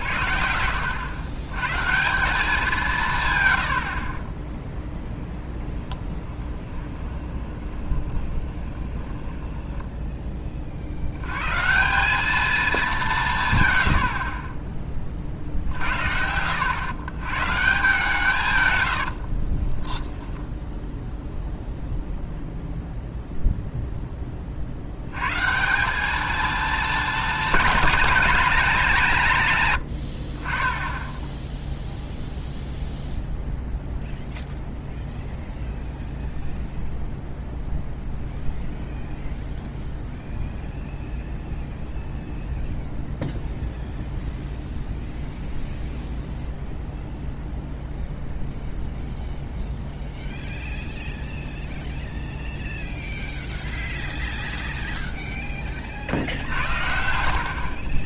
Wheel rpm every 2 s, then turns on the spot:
80, 170, 0, 20, 20, 40, 210, 20, 100, 110, 0, 0, 70, 230, 190, 10, 0, 0, 0, 0, 0, 0, 0, 0, 0, 0, 0, 0, 70.
6-10 14-16 56-58